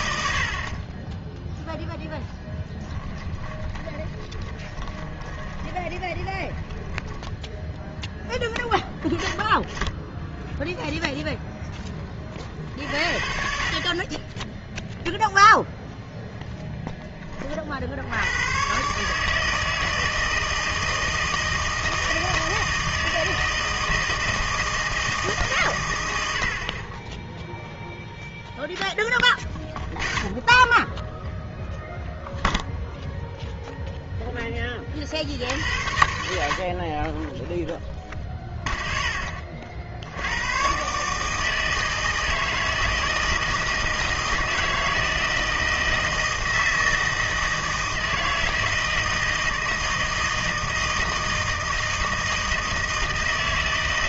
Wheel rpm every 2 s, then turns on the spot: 50, 10, 20, 20, 20, 0, 50, 10, 0, 120, 160, 160, 160, 60, 0, 10, 0, 20, 60, 0, 120, 160, 160, 160, 160, 160, 160.
2-8